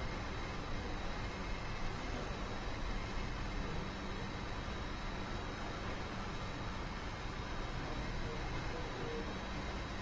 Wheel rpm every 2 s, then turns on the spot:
0, 0, 0, 0, 0.
none